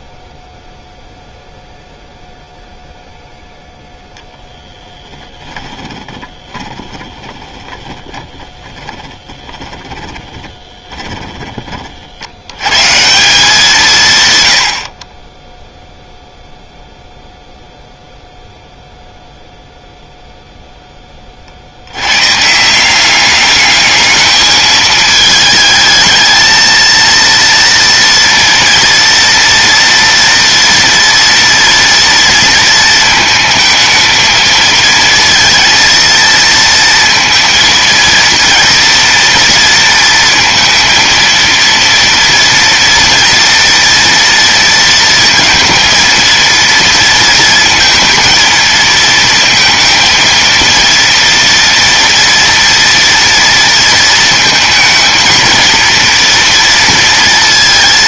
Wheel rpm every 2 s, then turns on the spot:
0, 0, 10, 10, 20, 20, 190, 10, 0, 0, 30, 200, 220, 230, 230, 230, 220, 230, 230, 230, 230, 230, 230, 230, 230, 230, 230, 230, 230.
4-12